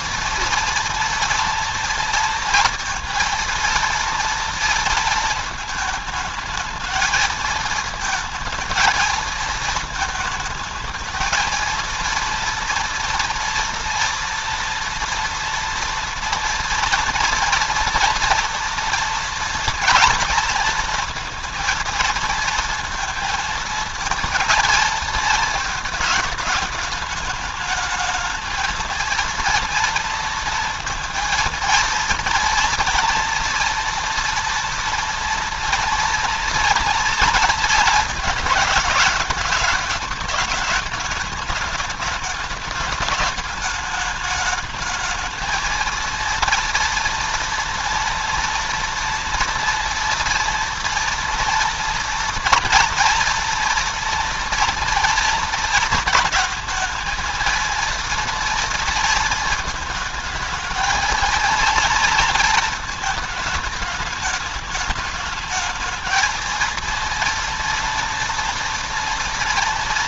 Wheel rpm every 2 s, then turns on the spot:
230, 230, 230, 220, 220, 220, 230, 230, 230, 230, 230, 230, 230, 220, 220, 230, 230, 230, 230, 220, 210, 210, 210, 230, 230, 240, 240, 230, 220, 230, 220, 230, 210, 230, 230.
none